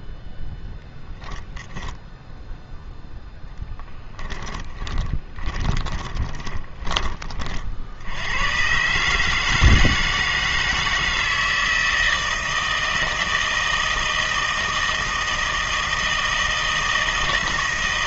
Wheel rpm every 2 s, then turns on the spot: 0, 0, 10, 20, 120, 160, 160, 160, 160.
4-8